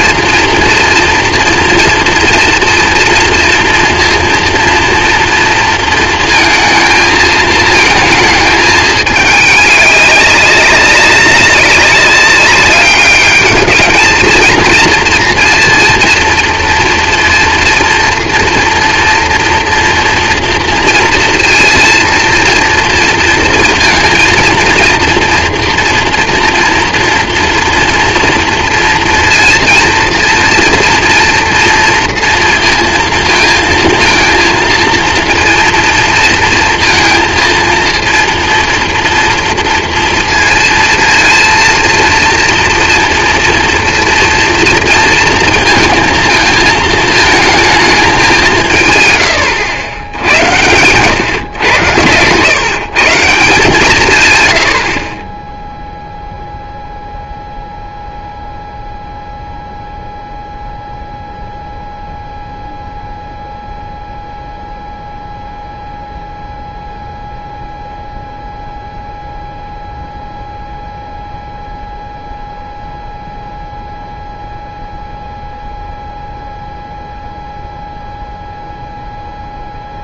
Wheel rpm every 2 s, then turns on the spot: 230, 230, 230, 230, 220, 200, 190, 220, 230, 230, 240, 230, 230, 230, 230, 230, 230, 230, 230, 230, 230, 230, 230, 230, 200, 110, 120, 120, 0, 0, 0, 0, 0, 0, 0, 0, 0, 0, 0, 0.
none